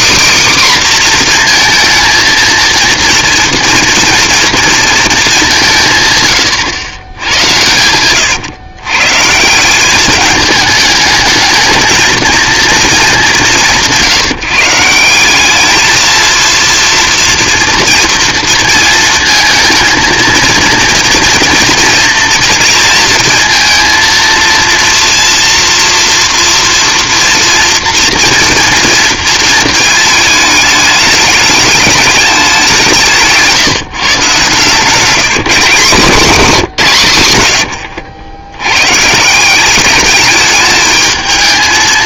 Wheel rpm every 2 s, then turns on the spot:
270, 230, 230, 110, 130, 210, 220, 160, 230, 230, 230, 230, 230, 240, 230, 210, 190, 150, 170, 120, 220.
36-38